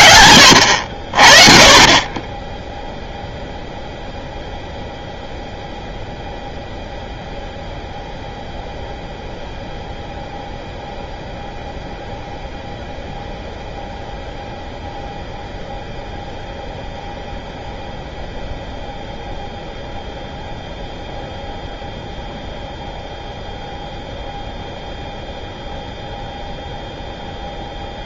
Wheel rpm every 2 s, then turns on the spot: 80, 0, 0, 0, 0, 0, 0, 0, 0, 0, 0, 0, 0, 0.
none